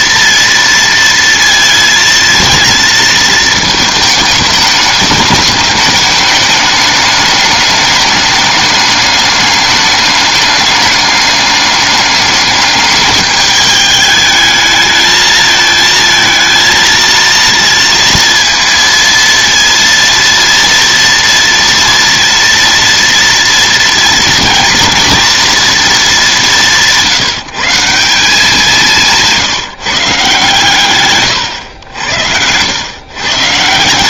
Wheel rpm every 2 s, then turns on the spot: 230, 230, 210, 210, 210, 210, 210, 220, 230, 230, 230, 230, 230, 160, 180, 130, 120.
28-30